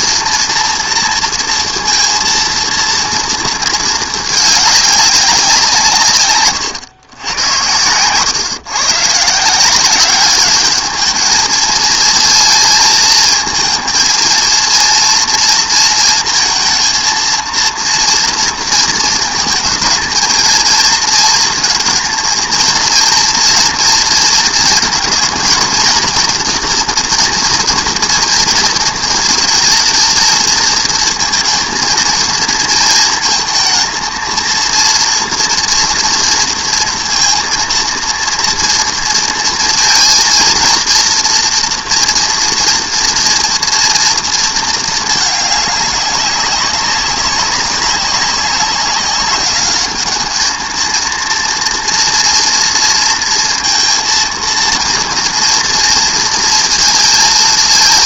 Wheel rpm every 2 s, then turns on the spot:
230, 230, 210, 130, 130, 210, 220, 230, 230, 220, 230, 230, 230, 230, 230, 220, 220, 230, 230, 230, 230, 230, 220, 190, 190, 220, 230, 230, 230.
none